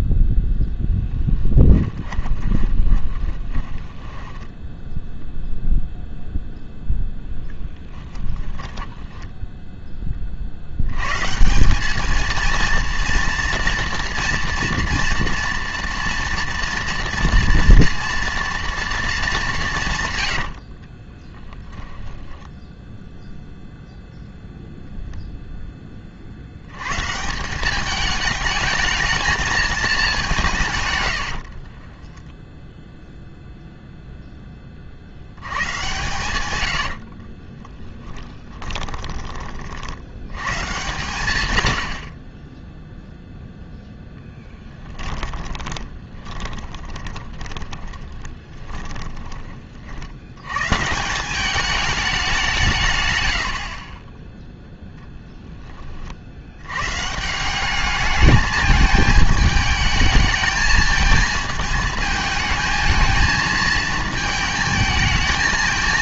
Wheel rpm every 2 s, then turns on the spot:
0, 20, 10, 0, 10, 70, 230, 230, 230, 240, 80, 10, 0, 90, 220, 160, 10, 20, 90, 20, 130, 20, 10, 20, 20, 140, 170, 0, 100, 210, 220, 220, 220.
2-4 8-10 20-24 36-40 44-50